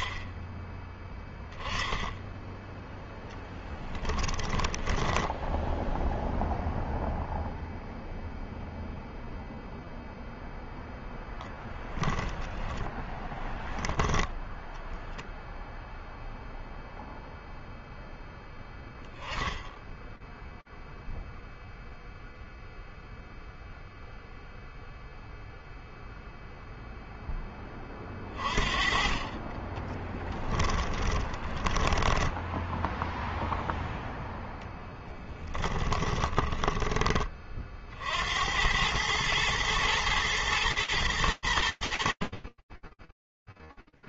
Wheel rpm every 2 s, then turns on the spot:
10, 10, 10, 0, 0, 10, 10, 0, 0, 10, 0, 0, 0, 20, 30, 20, 0, 20, 30, 110, 100, 0.
4-6 10-14 28-32 34-36